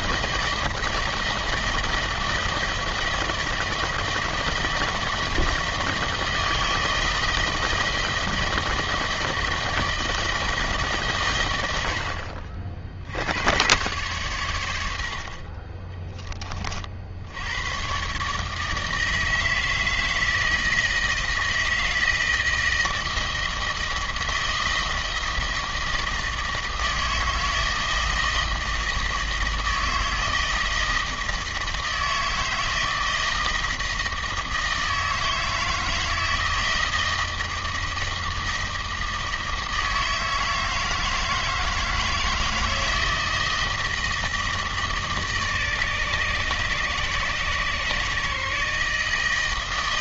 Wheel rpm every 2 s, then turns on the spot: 160, 160, 160, 160, 160, 150, 70, 80, 50, 160, 160, 160, 160, 160, 160, 160, 160, 160, 160, 160, 160, 160, 160, 130, 150.
none